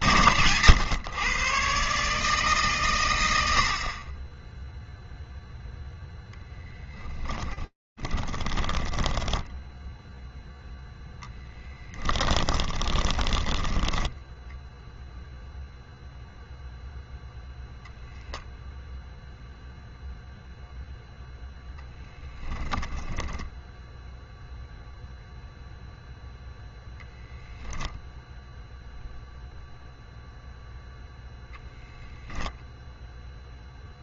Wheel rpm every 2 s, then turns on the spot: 60, 150, 20, 10, 10, 0, 10, 0, 0, 0, 10, 0, 0, 0, 0, 0, 0.
6-10 12-14 20-22